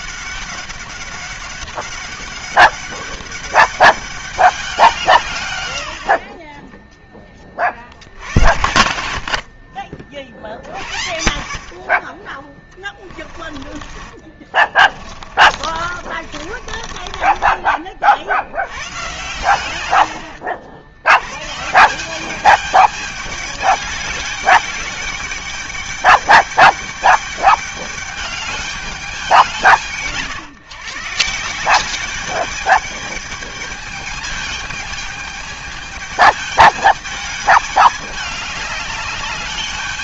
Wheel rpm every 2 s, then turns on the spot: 200, 200, 180, 20, 60, 80, 20, 30, 30, 110, 100, 210, 200, 210, 200, 140, 210, 210, 210, 210.
12-18